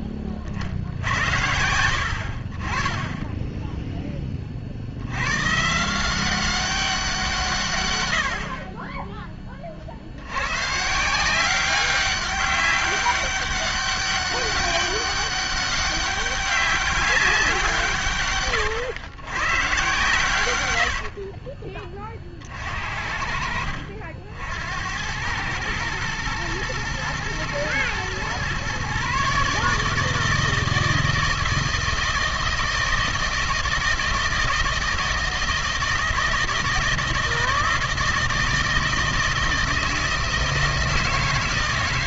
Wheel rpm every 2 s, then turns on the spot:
30, 40, 40, 190, 50, 120, 200, 200, 200, 120, 100, 60, 80, 120, 130, 160, 160, 160, 160, 160, 160.
none